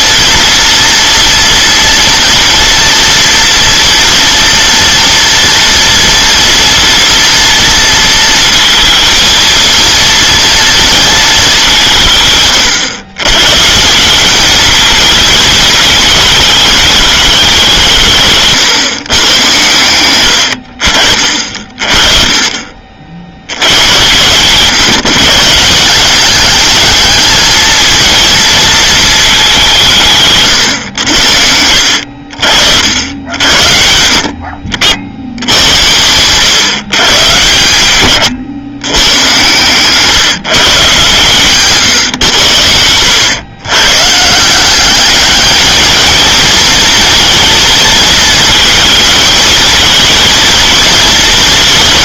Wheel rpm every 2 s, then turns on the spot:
230, 230, 230, 230, 230, 160, 160, 220, 160, 90, 40, 120, 180, 230, 170, 70, 70, 100, 120, 130, 140, 120, 220, 230, 230, 220.
40-42